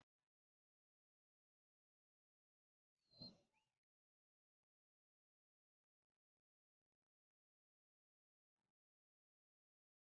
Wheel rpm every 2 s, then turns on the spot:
0, 0, 0, 0, 0.
none